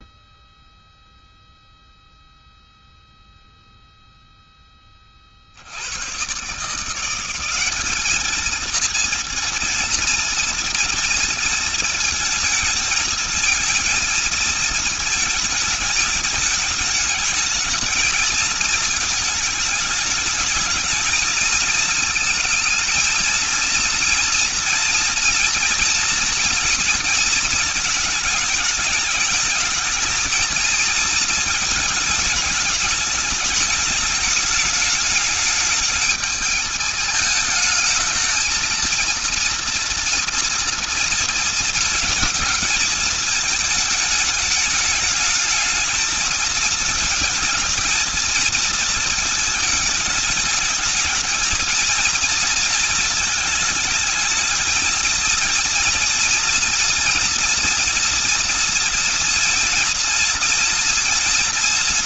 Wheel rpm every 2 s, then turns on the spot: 0, 0, 10, 140, 220, 230, 220, 230, 220, 220, 210, 220, 230, 230, 210, 230, 210, 210, 210, 220, 230, 220, 210, 220, 230, 210, 230, 220, 240, 230, 230.
none